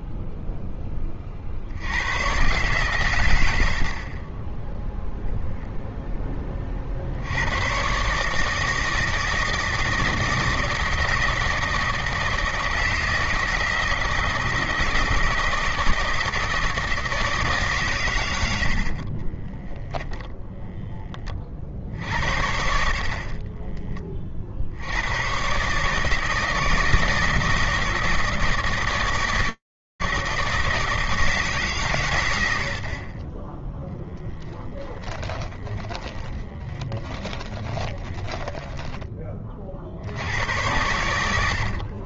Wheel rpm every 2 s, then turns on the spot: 10, 130, 10, 50, 160, 160, 160, 160, 160, 40, 20, 40, 110, 160, 160, 160, 90, 10, 20, 20, 100.
18-20 36-38 40-42